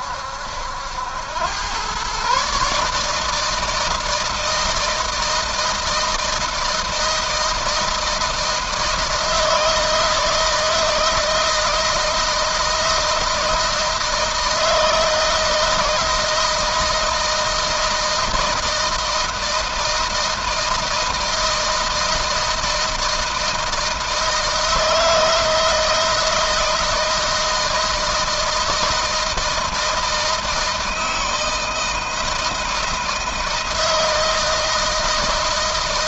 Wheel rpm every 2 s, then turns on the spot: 80, 150, 160, 160, 160, 160, 160, 160, 160, 160, 160, 160, 160, 160, 160, 160, 160, 160.
none